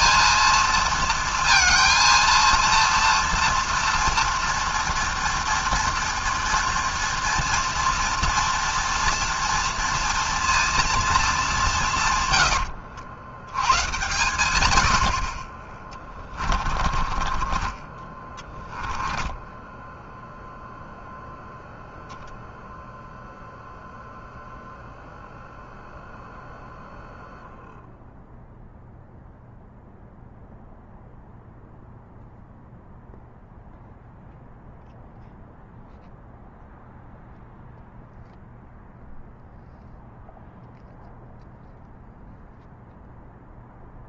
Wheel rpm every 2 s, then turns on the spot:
230, 230, 240, 230, 240, 230, 80, 100, 30, 10, 0, 0, 0, 0, 0, 0, 0, 0, 0, 0, 0, 0.
12-14 16-20